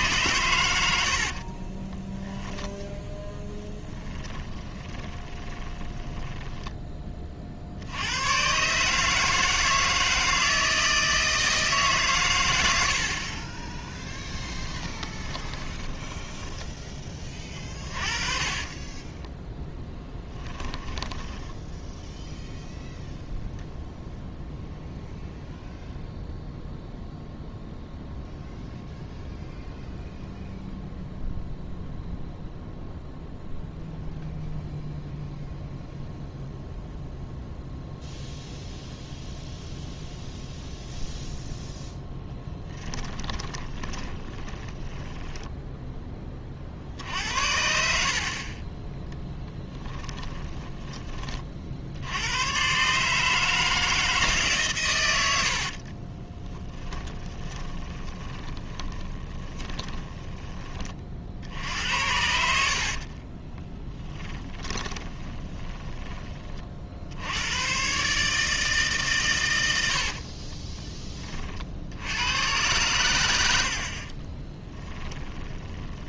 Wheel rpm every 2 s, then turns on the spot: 100, 10, 20, 20, 140, 160, 90, 20, 20, 20, 10, 0, 0, 0, 0, 0, 0, 0, 0, 0, 0, 10, 20, 60, 30, 30, 130, 140, 30, 20, 20, 60, 20, 50, 150, 30, 100, 10.
0-8 14-16 18-22 42-46 50-52 56-60 64-66 70-72 74-76